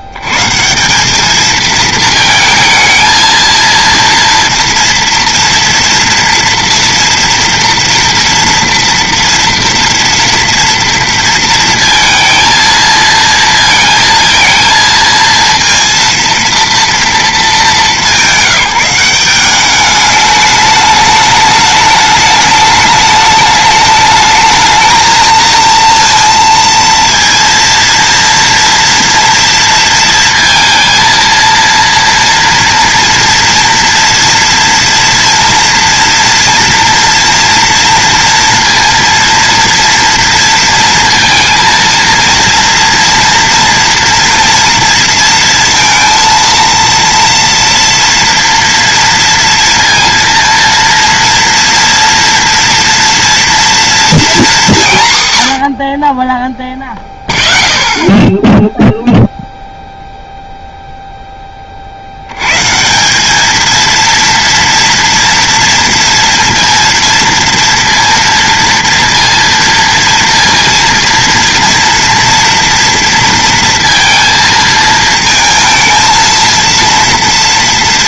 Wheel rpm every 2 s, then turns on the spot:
110, 220, 230, 230, 230, 230, 230, 230, 230, 180, 210, 210, 210, 230, 230, 230, 230, 230, 230, 230, 230, 230, 230, 230, 230, 230, 240, 230, 30, 0, 0, 90, 230, 230, 230, 230, 230, 230, 230.
none